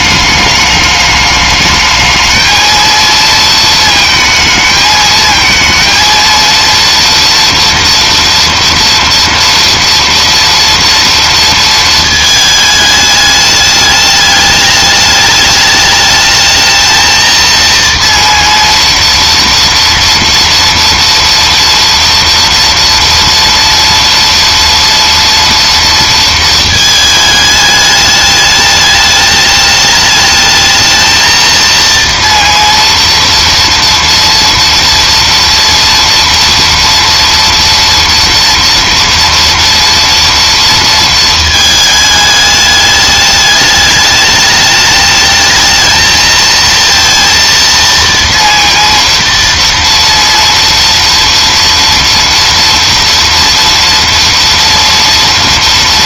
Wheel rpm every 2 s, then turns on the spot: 210, 220, 220, 230, 240, 230, 220, 210, 220, 230, 230, 230, 230, 220, 210, 220, 230, 240, 230, 230, 230, 210, 210, 230, 230, 230, 230, 230.
none